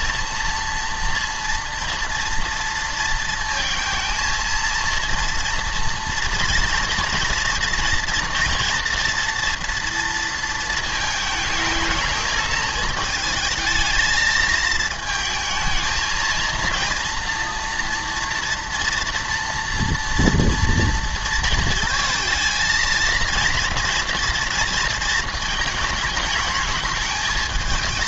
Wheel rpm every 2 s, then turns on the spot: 240, 230, 230, 230, 240, 220, 220, 220, 230, 230, 230, 230, 230, 220.
none